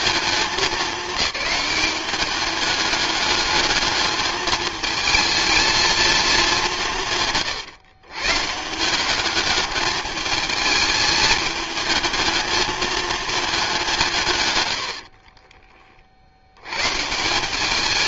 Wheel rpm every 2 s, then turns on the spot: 210, 200, 210, 190, 160, 210, 220, 110, 110.
none